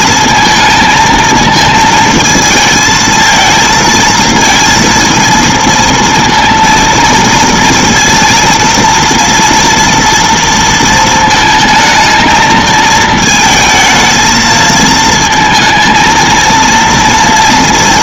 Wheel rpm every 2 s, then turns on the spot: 230, 220, 230, 230, 230, 230, 220, 220, 230.
none